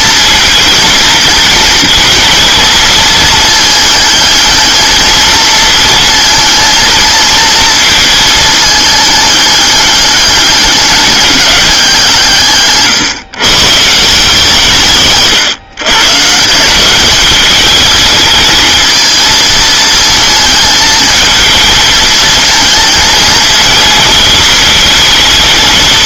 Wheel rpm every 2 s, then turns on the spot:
220, 220, 220, 230, 220, 200, 130, 160, 170, 220, 220, 220, 220.
none